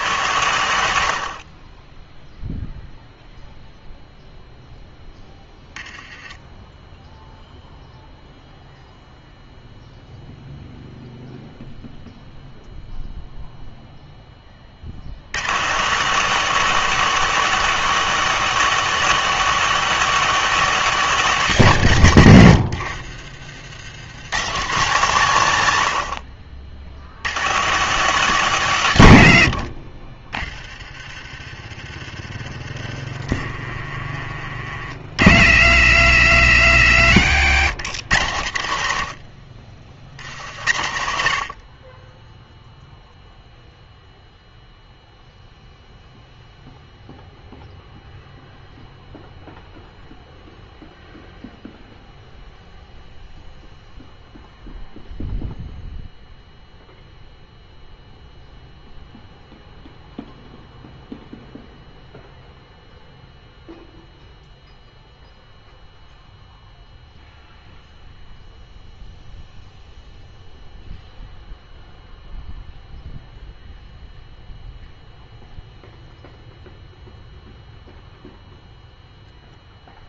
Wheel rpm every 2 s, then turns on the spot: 120, 0, 0, 10, 0, 0, 0, 30, 210, 210, 210, 70, 130, 70, 150, 30, 30, 40, 90, 90, 70, 0, 0, 0, 0, 0, 0, 0, 0, 0, 0, 0, 0, 0, 0, 0, 0, 0, 0, 0.
38-40